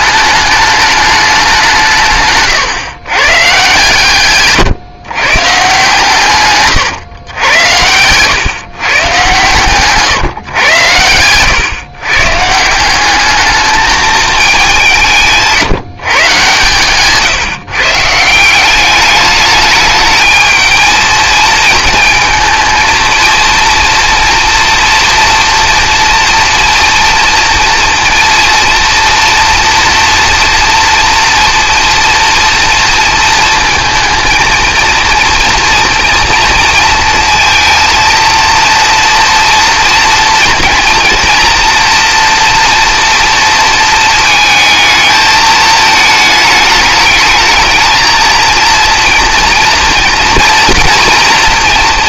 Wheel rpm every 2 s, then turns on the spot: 210, 130, 130, 130, 130, 110, 160, 200, 130, 190, 220, 220, 230, 230, 230, 230, 230, 230, 230, 230, 230, 230, 220, 220, 230, 230.
2-4